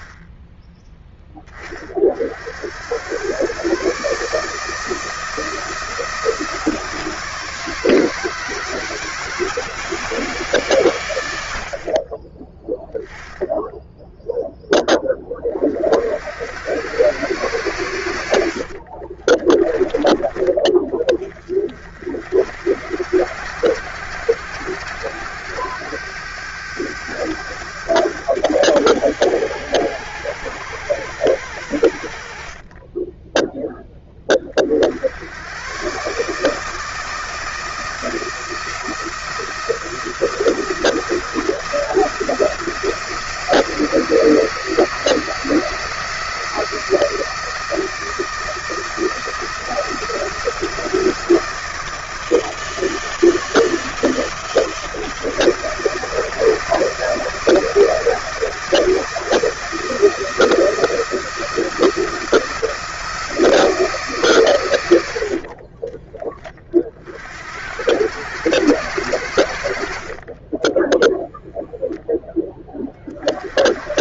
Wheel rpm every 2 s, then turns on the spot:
10, 110, 160, 160, 170, 100, 10, 20, 120, 30, 30, 80, 100, 100, 100, 100, 10, 90, 160, 170, 170, 160, 160, 160, 170, 170, 160, 160, 160, 160, 170, 170, 110, 30, 110, 20, 10.
18-20 32-34 70-72